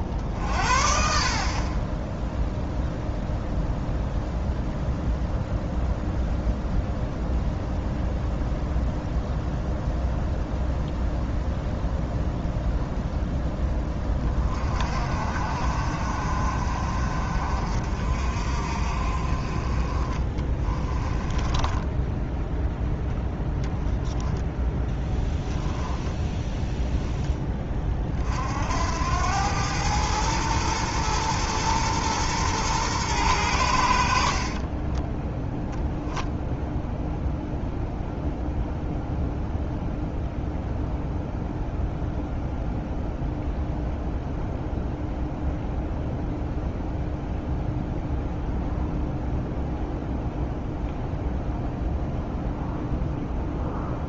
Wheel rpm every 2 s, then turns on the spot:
40, 0, 0, 0, 0, 0, 0, 40, 50, 50, 20, 10, 10, 0, 80, 110, 120, 30, 0, 0, 0, 0, 0, 0, 0, 0, 0.
20-22 24-26 34-36